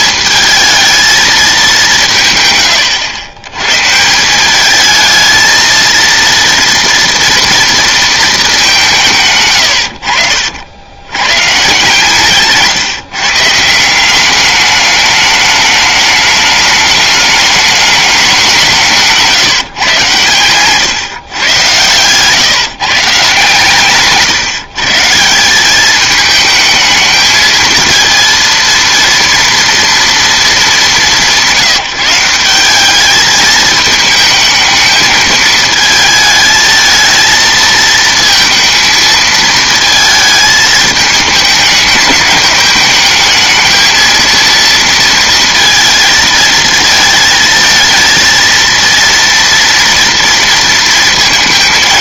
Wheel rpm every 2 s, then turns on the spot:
220, 120, 200, 230, 190, 90, 150, 210, 210, 180, 120, 140, 150, 220, 230, 200, 200, 220, 220, 230, 220, 220, 230, 230, 230, 230.
none